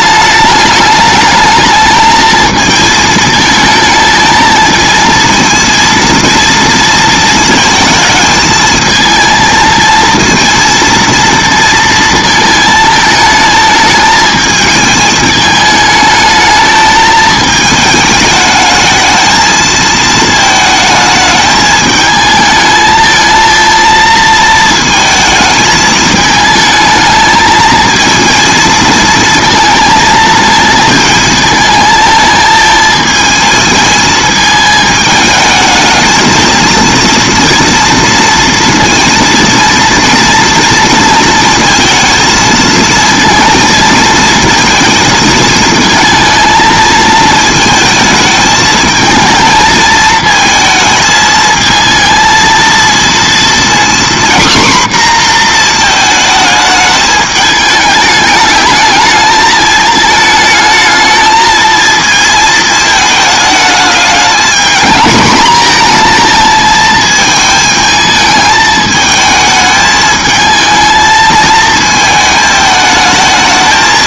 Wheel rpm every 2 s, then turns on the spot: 210, 220, 220, 230, 220, 230, 220, 220, 220, 210, 220, 220, 230, 220, 230, 220, 220, 220, 230, 230, 230, 220, 220, 220, 220, 220, 230, 260, 220, 210, 220, 220, 220, 220, 220, 220, 220.
none